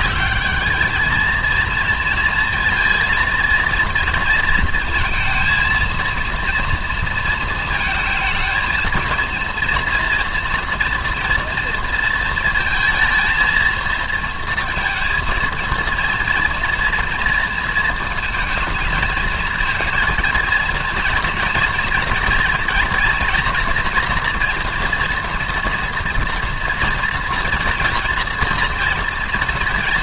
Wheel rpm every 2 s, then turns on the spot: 210, 230, 230, 230, 230, 230, 230, 230, 230, 220, 230, 230, 230, 240, 230.
none